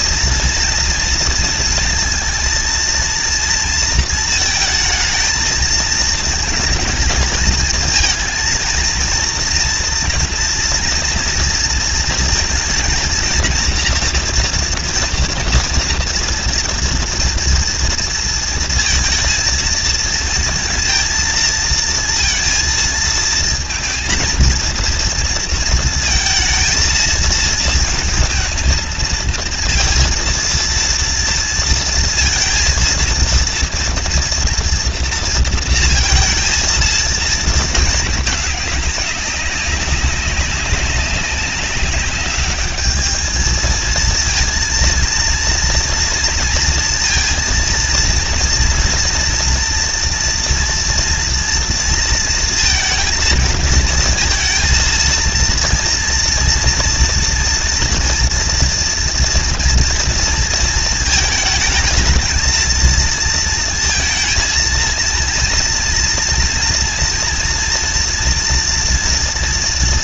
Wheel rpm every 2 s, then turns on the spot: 230, 230, 230, 220, 220, 230, 230, 230, 230, 230, 220, 230, 230, 230, 230, 230, 230, 230, 230, 210, 200, 200, 230, 230, 230, 230, 230, 230, 230, 230, 230, 230, 230, 230, 240.
none